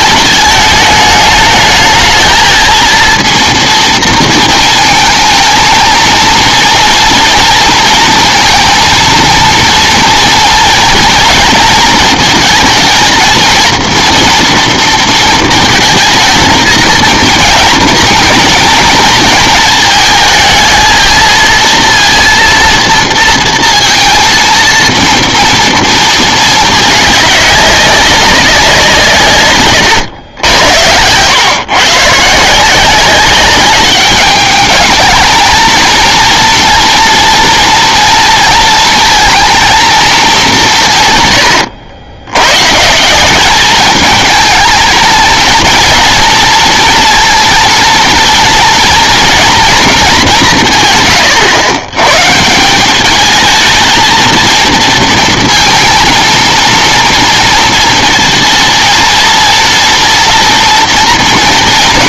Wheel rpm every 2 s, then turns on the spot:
210, 230, 220, 230, 230, 230, 230, 230, 230, 230, 220, 230, 230, 210, 190, 100, 180, 210, 230, 230, 180, 140, 220, 230, 230, 160, 170, 230, 230, 230, 240.
30-32